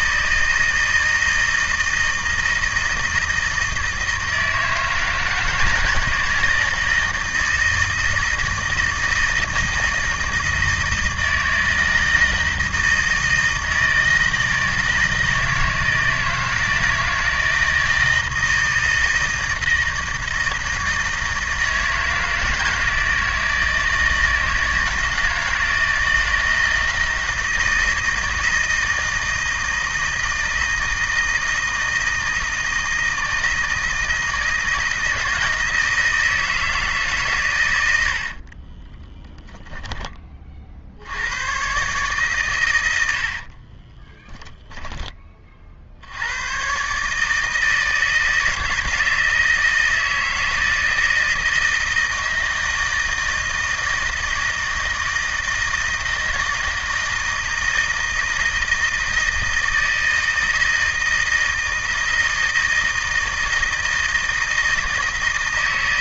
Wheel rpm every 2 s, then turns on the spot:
160, 160, 160, 160, 160, 160, 160, 160, 170, 160, 160, 160, 160, 160, 160, 160, 160, 160, 170, 40, 50, 110, 10, 120, 160, 160, 160, 160, 160, 160, 160, 160, 160.
38-40 44-46